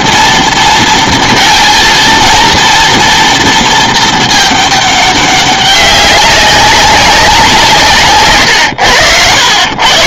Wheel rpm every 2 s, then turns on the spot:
230, 230, 210, 200, 100.
none